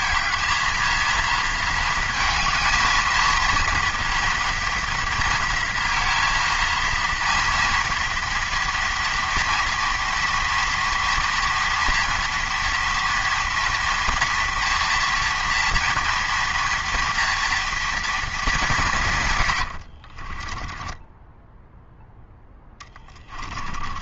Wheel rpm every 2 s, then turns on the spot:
230, 220, 230, 230, 230, 230, 230, 240, 230, 190, 20, 10.
20-24